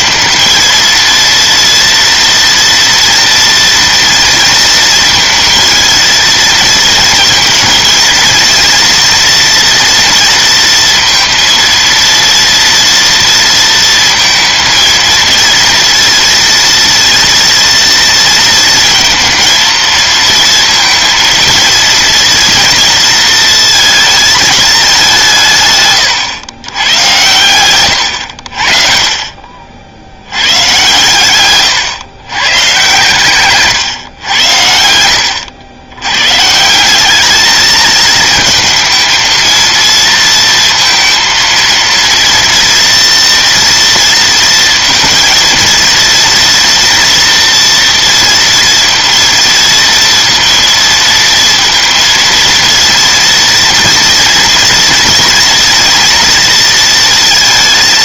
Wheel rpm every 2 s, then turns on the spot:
230, 230, 230, 220, 230, 230, 230, 230, 230, 230, 230, 230, 210, 110, 50, 120, 120, 80, 180, 220, 230, 230, 230, 230, 230, 230, 230, 230, 230.
none